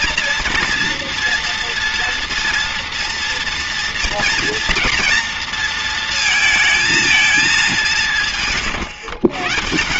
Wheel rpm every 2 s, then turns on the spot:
230, 230, 230, 230, 140.
none